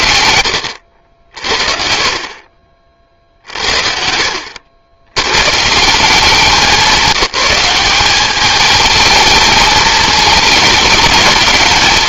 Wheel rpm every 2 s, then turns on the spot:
70, 50, 100, 190, 220, 220.
none